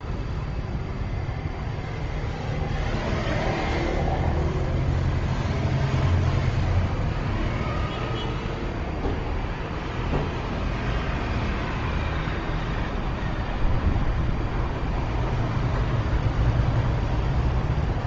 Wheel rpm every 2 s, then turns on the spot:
0, 0, 0, 0, 0, 0, 0, 0, 0.
none